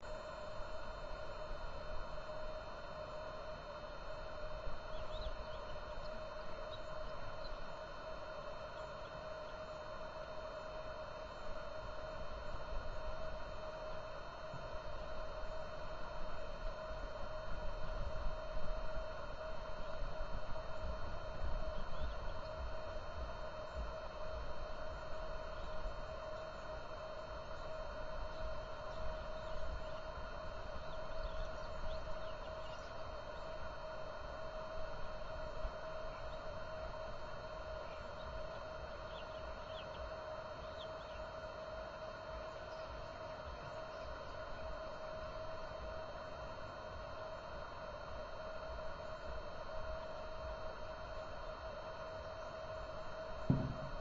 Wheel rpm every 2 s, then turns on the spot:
0, 0, 0, 0, 0, 0, 0, 0, 0, 0, 0, 0, 0, 0, 0, 0, 0, 0, 0, 0, 0, 0, 0, 0, 0, 0, 0.
none